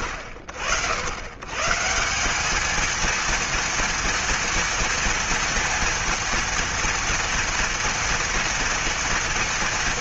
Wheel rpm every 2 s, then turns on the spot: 80, 210, 230, 230, 230.
none